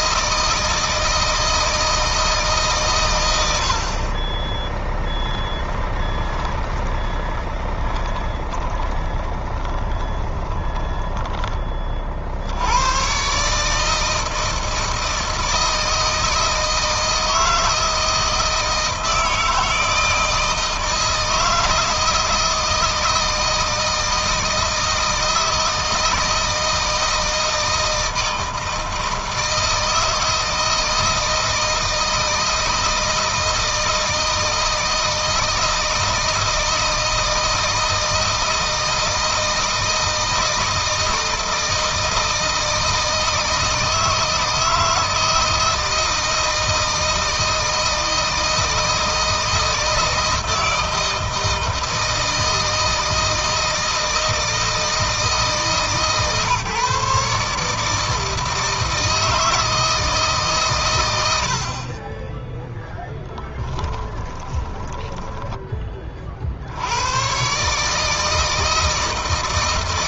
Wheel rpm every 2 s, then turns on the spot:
160, 130, 10, 10, 20, 20, 100, 160, 160, 160, 160, 160, 160, 160, 160, 160, 160, 160, 160, 160, 160, 160, 160, 160, 160, 160, 160, 160, 150, 160, 120, 10, 20, 80, 160.
4-12 64-66